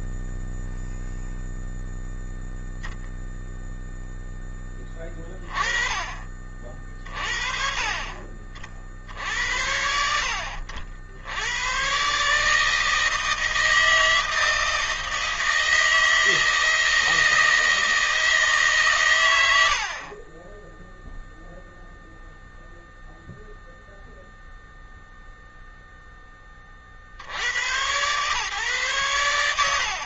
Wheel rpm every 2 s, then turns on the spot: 0, 0, 10, 40, 50, 70, 140, 160, 160, 160, 10, 0, 0, 10, 110.
none